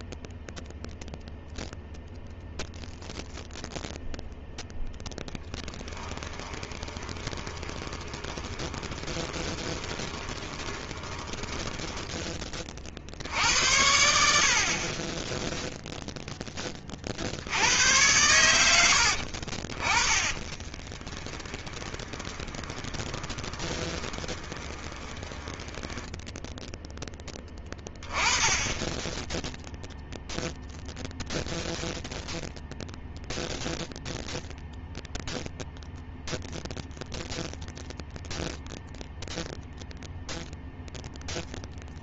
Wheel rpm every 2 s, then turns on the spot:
0, 0, 0, 20, 20, 20, 40, 50, 20, 90, 20, 20, 20, 0, 20, 0, 0, 0, 0, 0, 0.
6-12 20-26